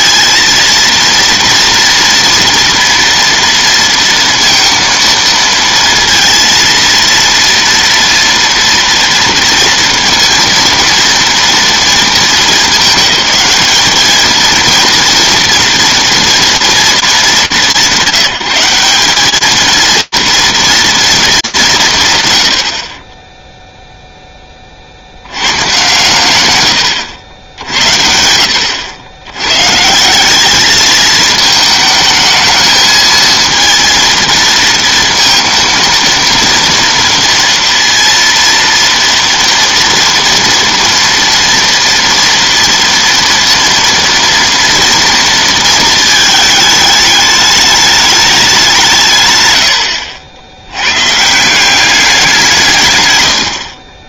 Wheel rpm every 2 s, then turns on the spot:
230, 230, 230, 230, 230, 230, 210, 230, 210, 180, 220, 20, 70, 90, 110, 220, 220, 230, 230, 230, 230, 230, 230, 210, 150, 130, 110.
none